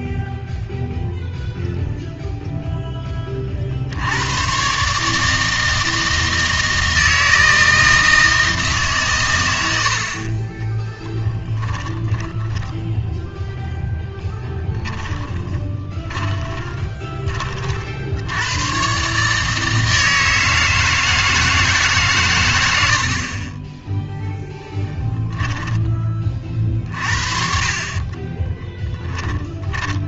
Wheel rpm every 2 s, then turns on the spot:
0, 0, 130, 160, 150, 20, 10, 30, 20, 110, 160, 90, 10, 40, 20.
12-18 24-26 28-30